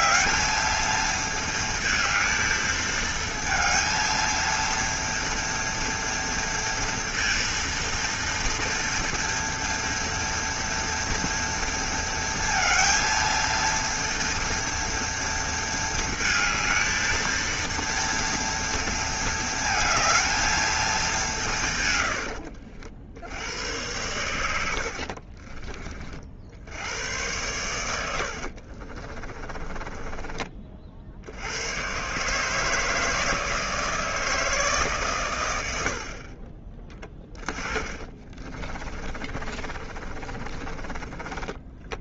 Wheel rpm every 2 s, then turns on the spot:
220, 220, 230, 230, 230, 230, 230, 230, 220, 230, 220, 70, 80, 80, 50, 40, 150, 150, 20, 20, 20.
24-26 28-30 38-42